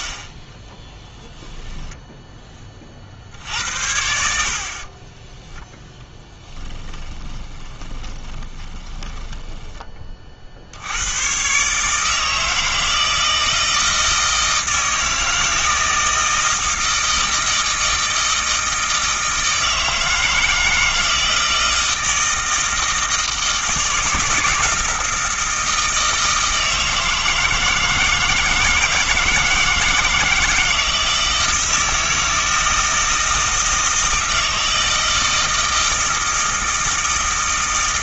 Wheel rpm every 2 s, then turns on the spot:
10, 40, 40, 10, 20, 70, 160, 160, 160, 160, 160, 160, 160, 160, 160, 160, 160, 160, 160.
0-2 6-10